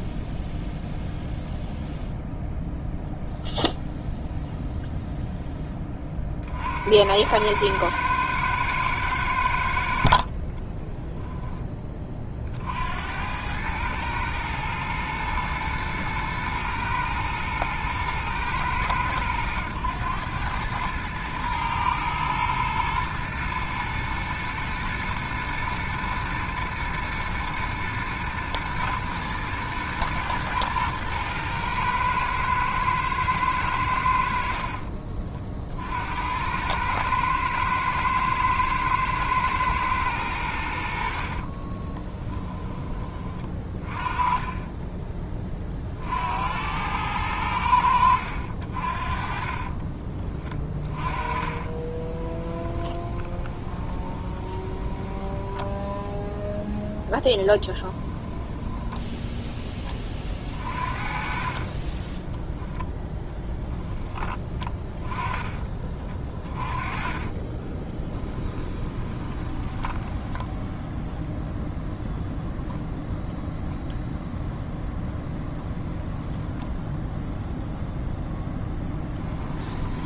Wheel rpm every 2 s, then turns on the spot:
0, 0, 0, 60, 110, 30, 70, 110, 110, 110, 110, 120, 110, 110, 110, 110, 110, 50, 100, 110, 70, 10, 20, 80, 50, 20, 20, 10, 10, 10, 40, 10, 30, 30, 20, 0, 0, 0, 10, 10.
10-12 50-64 66-70